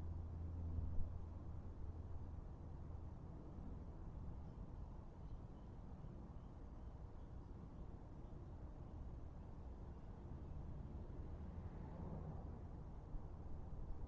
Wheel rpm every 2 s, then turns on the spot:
0, 0, 0, 0, 0, 0, 0.
none